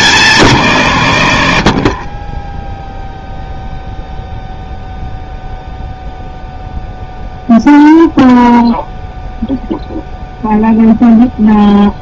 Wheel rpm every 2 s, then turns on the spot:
140, 0, 0, 0, 0, 0.
none